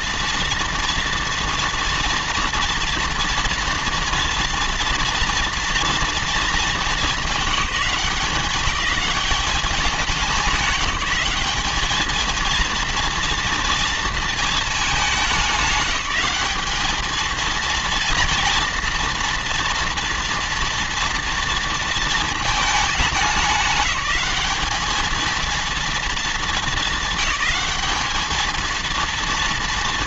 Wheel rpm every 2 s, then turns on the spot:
230, 230, 230, 210, 200, 200, 230, 210, 200, 230, 230, 220, 220, 220, 230.
none